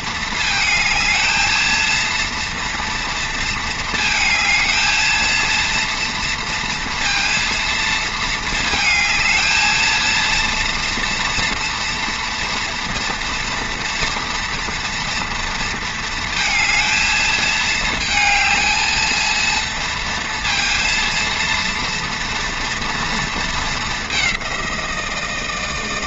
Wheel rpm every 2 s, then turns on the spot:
230, 230, 220, 230, 220, 230, 230, 230, 220, 220, 230, 230, 180.
none